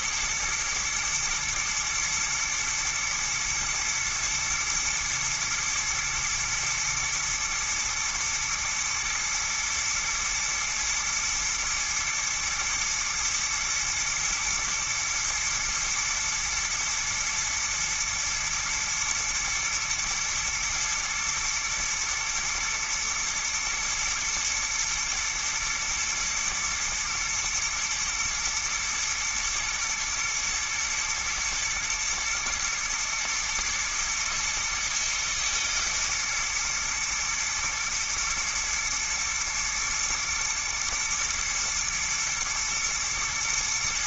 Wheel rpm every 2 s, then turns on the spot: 110, 120, 120, 110, 110, 110, 110, 120, 110, 120, 120, 120, 120, 110, 110, 110, 120, 110, 120, 110, 120, 110.
none